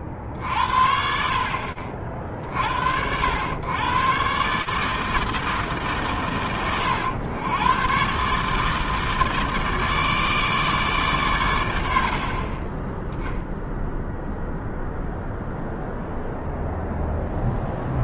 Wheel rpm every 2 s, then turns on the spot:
30, 50, 140, 100, 150, 150, 30, 0, 0.
none